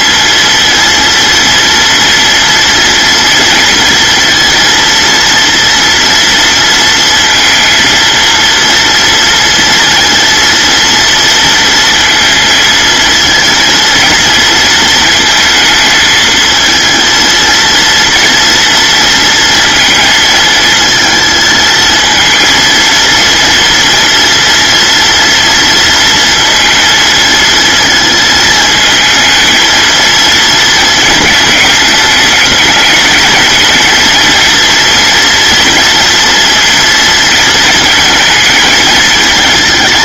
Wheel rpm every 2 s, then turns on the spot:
230, 230, 230, 230, 230, 230, 230, 230, 220, 230, 220, 230, 230, 230, 220, 230, 220, 230, 230, 220.
none